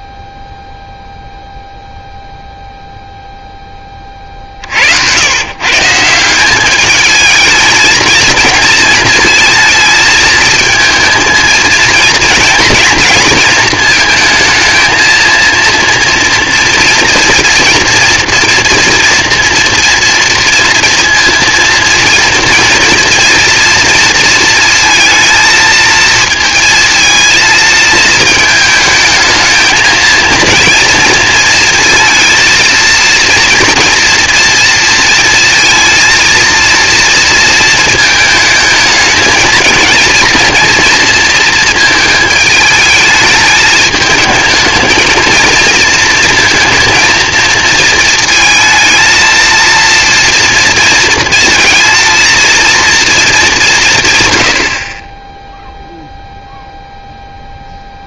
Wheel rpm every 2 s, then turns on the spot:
0, 0, 90, 220, 220, 220, 230, 230, 240, 230, 230, 230, 230, 230, 220, 230, 230, 230, 230, 210, 230, 210, 220, 230, 230, 230, 230, 20, 10.
none